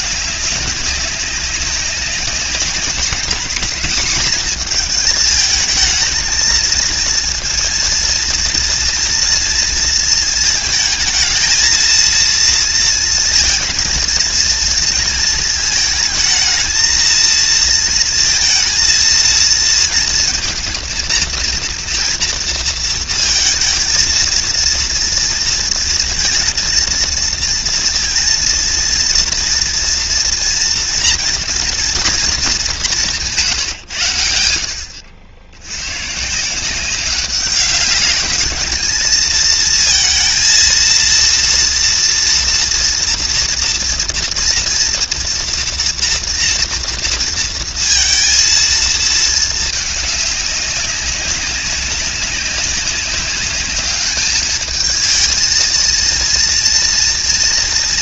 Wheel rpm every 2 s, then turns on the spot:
200, 200, 220, 220, 230, 220, 230, 230, 220, 230, 230, 230, 230, 230, 230, 230, 190, 70, 170, 210, 230, 230, 230, 230, 230, 200, 200, 210, 230.
none